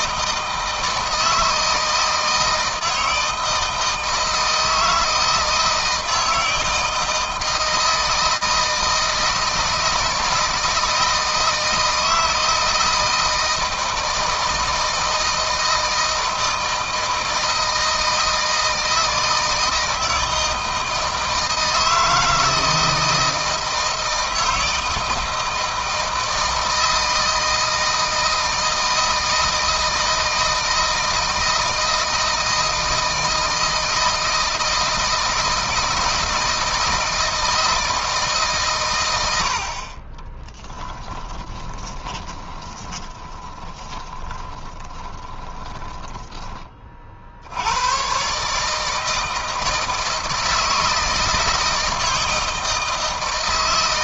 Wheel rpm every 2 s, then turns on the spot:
160, 160, 160, 160, 160, 160, 160, 160, 160, 160, 160, 160, 160, 160, 160, 160, 160, 160, 160, 110, 20, 20, 30, 50, 160, 160, 160.
40-46